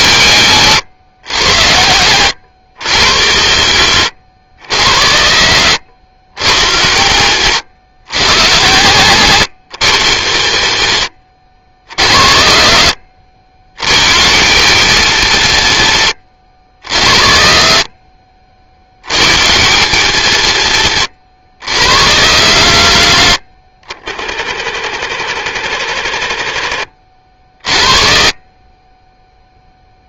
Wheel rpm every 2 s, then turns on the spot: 110, 110, 90, 100, 120, 100, 70, 140, 80, 50, 120, 110, 50, 50, 30.
26-28